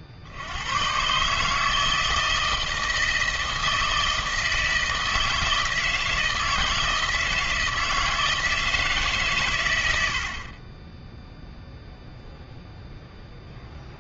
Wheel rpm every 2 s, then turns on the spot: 60, 160, 160, 160, 160, 40, 0.
none